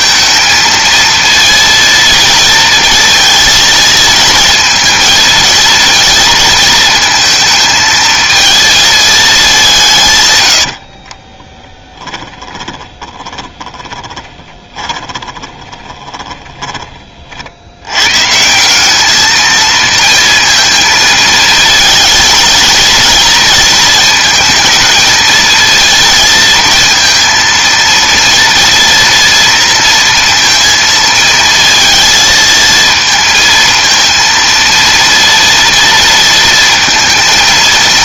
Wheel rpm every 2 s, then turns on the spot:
230, 230, 230, 230, 220, 90, 10, 10, 20, 170, 230, 230, 230, 230, 230, 230, 230, 230, 230.
10-18